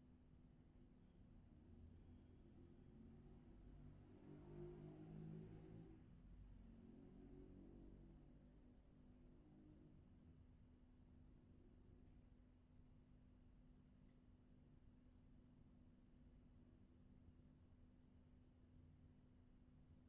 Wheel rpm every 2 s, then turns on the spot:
0, 0, 0, 0, 0, 0, 0, 0, 0, 0.
none